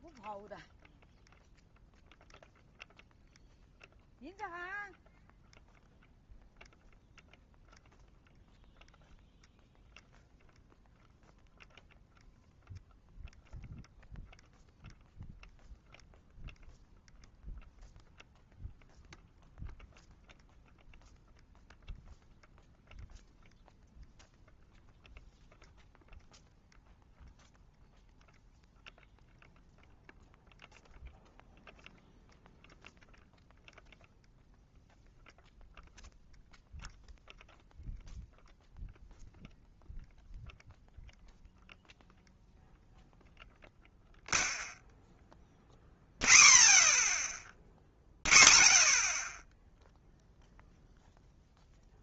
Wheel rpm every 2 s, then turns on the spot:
0, 0, 0, 0, 0, 0, 0, 0, 0, 0, 0, 0, 0, 0, 0, 0, 0, 0, 0, 0, 0, 0, 0, 0, 0, 0.
none